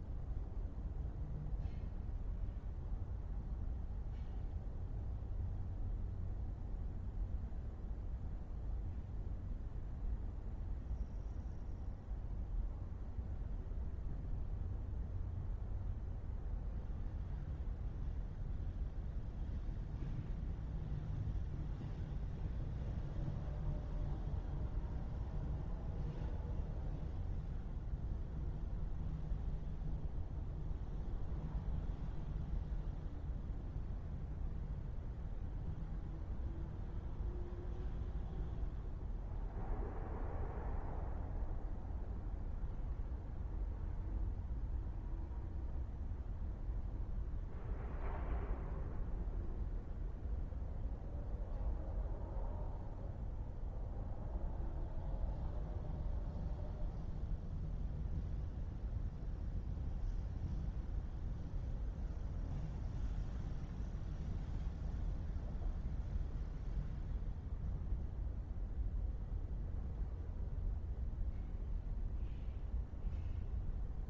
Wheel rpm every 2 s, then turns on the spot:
0, 0, 0, 0, 0, 0, 0, 0, 0, 0, 0, 0, 0, 0, 0, 0, 0, 0, 0, 0, 0, 0, 0, 0, 0, 0, 0, 0, 0, 0, 0, 0, 0, 0, 0, 0, 0.
none